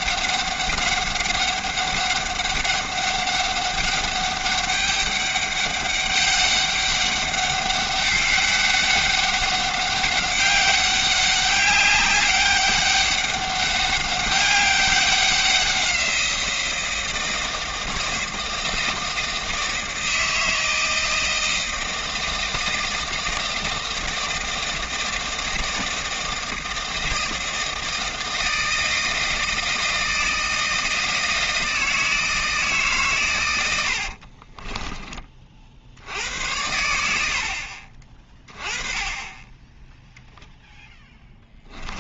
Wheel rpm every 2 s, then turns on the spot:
200, 200, 200, 200, 200, 200, 200, 200, 170, 160, 160, 160, 160, 160, 160, 160, 150, 30, 80, 20, 0.
34-36